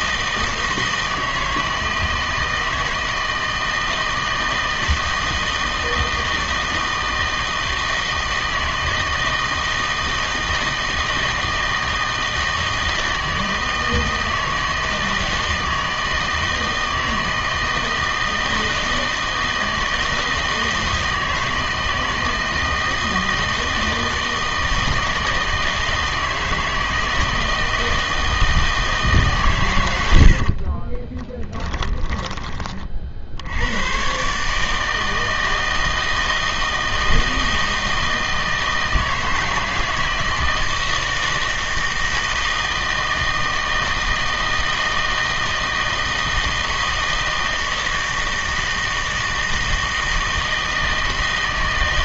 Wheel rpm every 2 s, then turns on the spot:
160, 160, 160, 160, 160, 160, 160, 160, 160, 160, 160, 160, 160, 160, 160, 40, 20, 150, 160, 160, 160, 160, 160, 160, 160, 160.
30-32